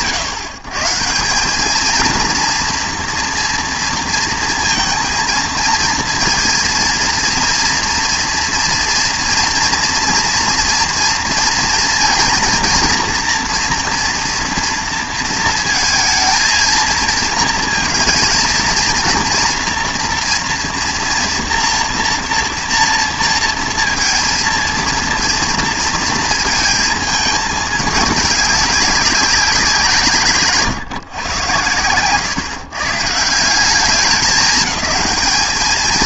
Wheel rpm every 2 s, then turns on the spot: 140, 230, 230, 230, 240, 230, 230, 230, 230, 230, 230, 230, 230, 220, 200, 140, 120, 220.
none